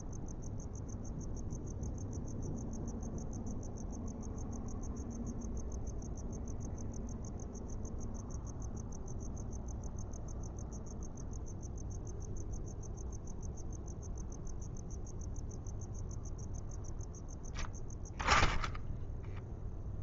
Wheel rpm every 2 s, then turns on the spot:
0, 0, 0, 0, 0, 0, 0, 0, 0, 0.
none